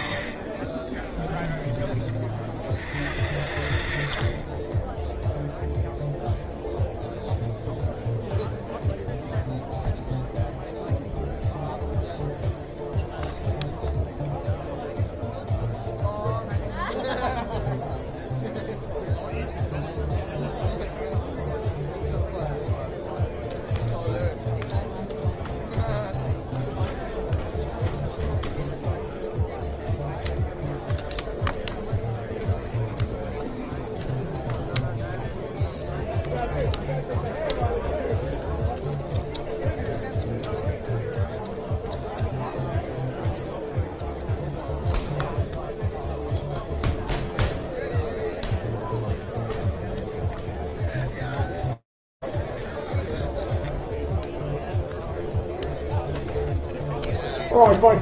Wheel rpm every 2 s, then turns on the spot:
40, 50, 30, 0, 0, 0, 0, 0, 0, 0, 0, 0, 0, 0, 0, 0, 0, 0, 0, 0, 0, 0, 0, 0, 0, 0, 0, 0, 0.
0-2